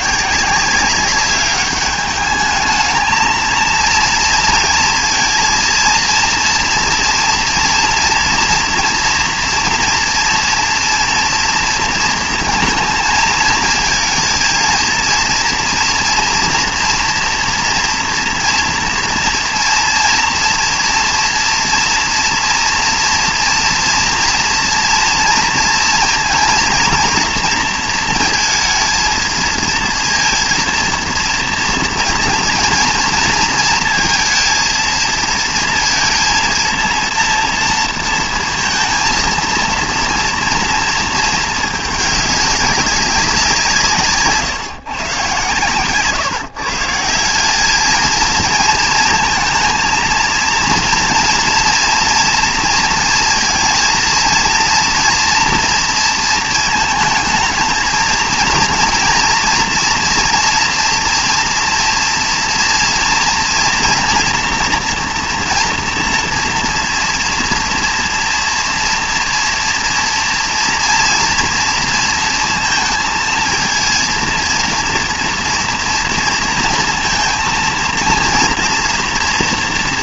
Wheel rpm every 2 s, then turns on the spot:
190, 220, 230, 230, 230, 230, 220, 230, 230, 230, 230, 230, 230, 230, 230, 230, 230, 230, 230, 230, 230, 200, 140, 150, 230, 230, 230, 230, 230, 230, 230, 230, 240, 230, 230, 230, 230, 230, 230, 230.
none